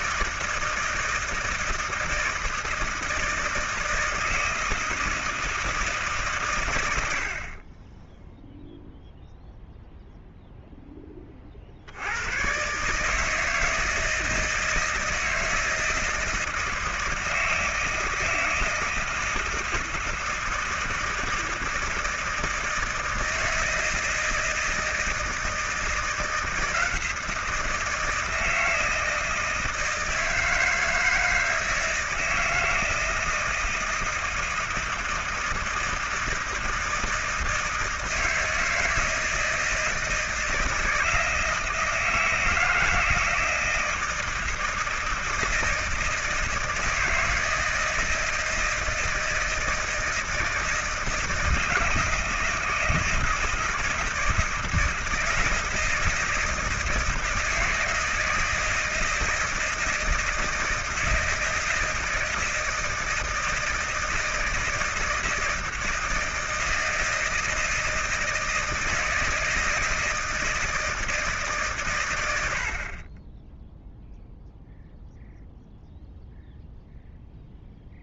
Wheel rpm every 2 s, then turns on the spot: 160, 160, 160, 120, 0, 0, 130, 160, 160, 160, 160, 160, 160, 170, 160, 160, 160, 160, 160, 160, 170, 160, 160, 160, 160, 160, 160, 160, 160, 160, 160, 160, 160, 160, 160, 160, 80, 0, 0.
none